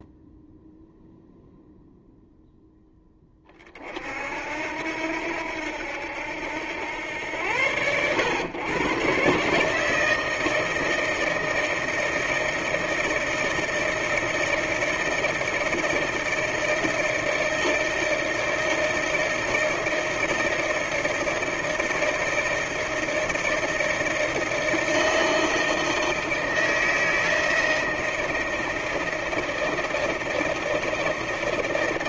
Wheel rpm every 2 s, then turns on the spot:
0, 0, 70, 90, 120, 160, 160, 160, 160, 160, 160, 160, 160, 160, 160, 160.
none